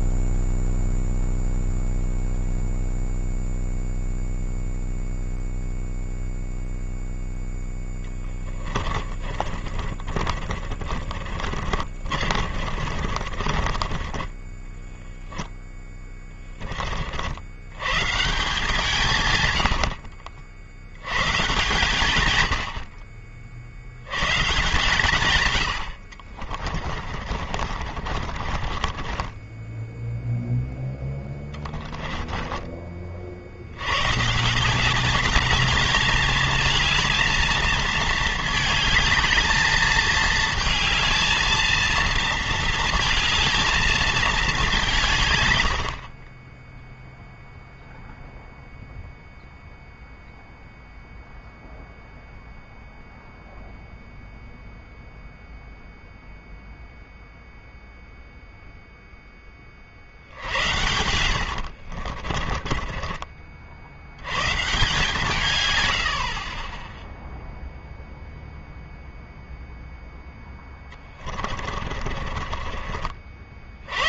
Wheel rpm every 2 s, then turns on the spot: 0, 0, 0, 0, 20, 30, 40, 10, 40, 150, 80, 80, 150, 40, 30, 10, 40, 180, 220, 210, 220, 220, 180, 10, 0, 0, 0, 0, 0, 0, 90, 40, 140, 20, 0, 10, 40.
8-16 26-30 60-64 70-72